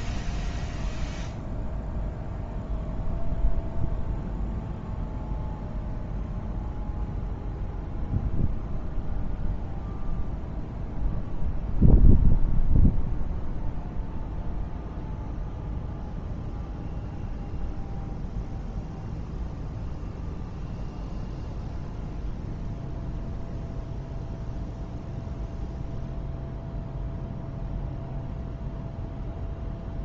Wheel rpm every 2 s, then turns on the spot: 0, 0, 0, 0, 0, 0, 0, 0, 0, 0, 0, 0, 0, 0, 0.
none